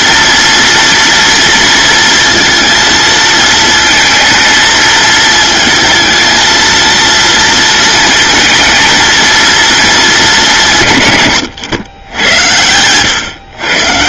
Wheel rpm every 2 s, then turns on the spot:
230, 230, 220, 230, 220, 130, 110.
none